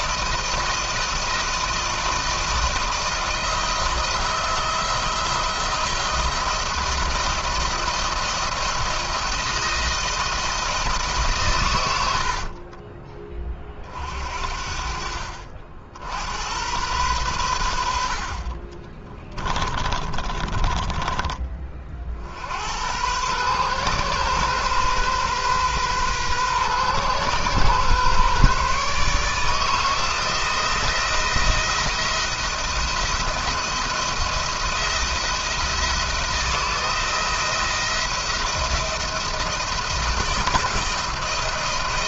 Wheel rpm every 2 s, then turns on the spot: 160, 160, 170, 170, 170, 160, 50, 50, 90, 40, 30, 70, 130, 130, 140, 170, 170, 170, 170, 170, 170.
12-14 18-22